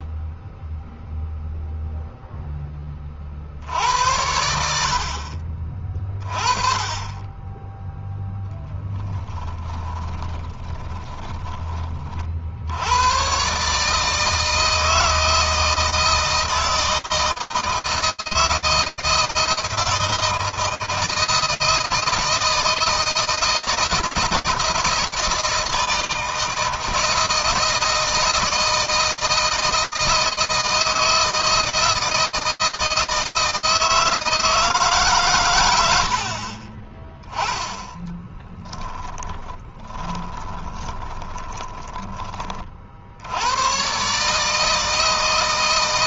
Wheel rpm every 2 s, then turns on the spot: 0, 20, 70, 20, 10, 30, 90, 160, 160, 160, 160, 160, 160, 160, 160, 160, 160, 130, 20, 20, 10, 120, 160.
8-12 38-40